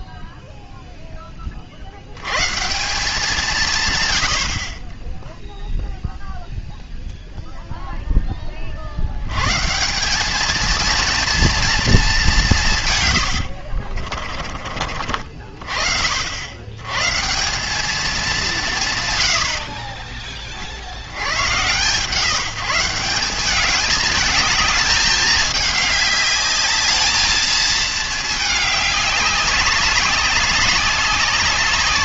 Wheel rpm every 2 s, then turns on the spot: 0, 160, 40, 0, 50, 230, 160, 40, 110, 150, 60, 170, 210, 210, 210, 200.
none